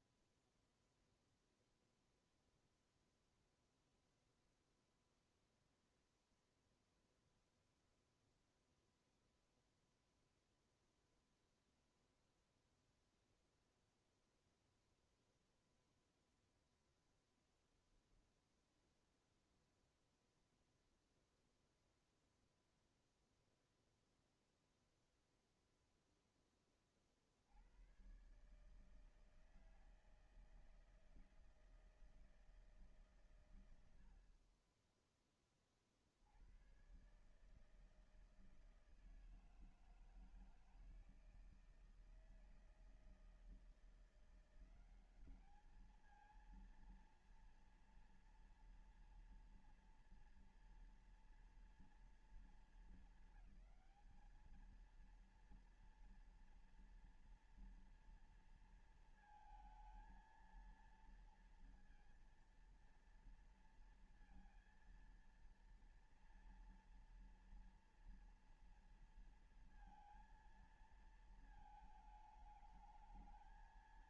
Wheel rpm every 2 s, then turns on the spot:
0, 0, 0, 0, 0, 0, 0, 0, 0, 0, 0, 0, 0, 40, 150, 160, 130, 10, 120, 160, 160, 160, 180, 220, 230, 240, 220, 220, 230, 230, 230, 230, 230, 230, 230, 230, 220.
none